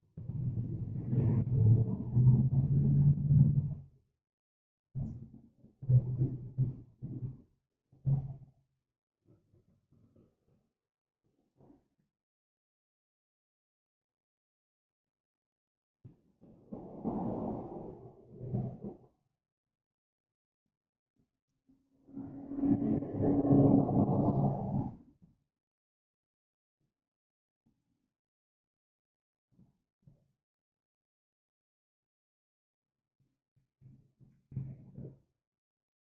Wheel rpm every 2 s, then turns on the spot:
0, 0, 0, 0, 0, 0, 0, 0, 0, 0, 0, 0, 0, 0, 0, 0, 0, 0.
none